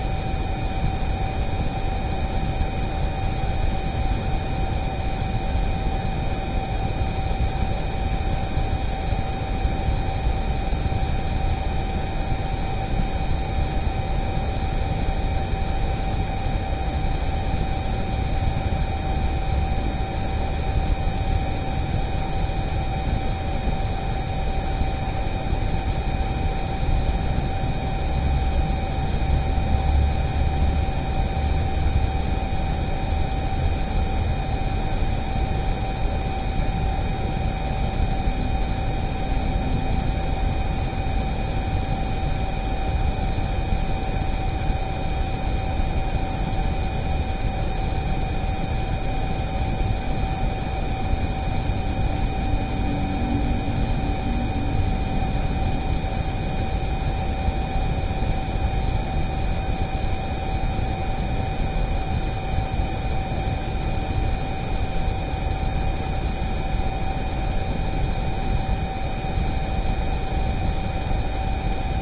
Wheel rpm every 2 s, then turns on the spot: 0, 0, 0, 0, 0, 0, 0, 0, 0, 0, 0, 0, 0, 0, 0, 0, 0, 0, 0, 0, 0, 0, 0, 0, 0, 0, 0, 0, 0, 0, 0, 0, 0, 0, 0, 0.
none